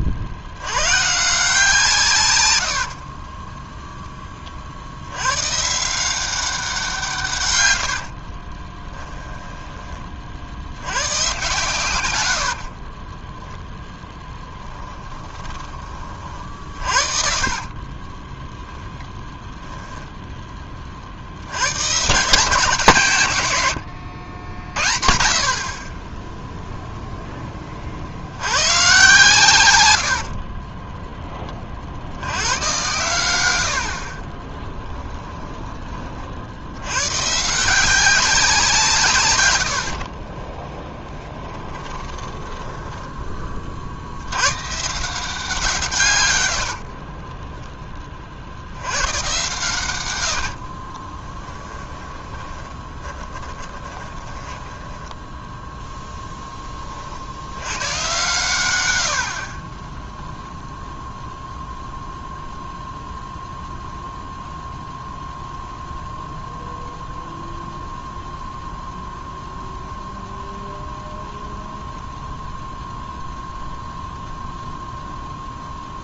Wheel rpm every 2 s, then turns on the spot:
120, 70, 50, 160, 10, 80, 30, 10, 50, 10, 30, 160, 50, 0, 130, 20, 110, 10, 100, 170, 10, 10, 150, 60, 90, 40, 20, 10, 20, 100, 0, 0, 0, 0, 0, 0, 0, 0.
2-4 8-10 12-18 30-32 34-36 40-42 46-48 50-56 58-60